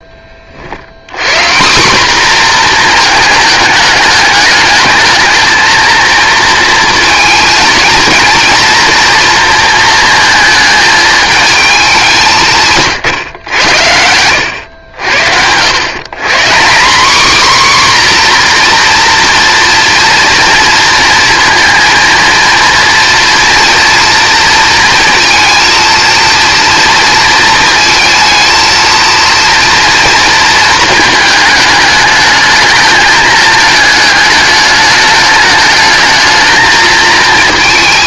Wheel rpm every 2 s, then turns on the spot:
70, 240, 220, 220, 230, 220, 150, 90, 200, 250, 230, 230, 230, 230, 230, 230, 220, 210, 220.
none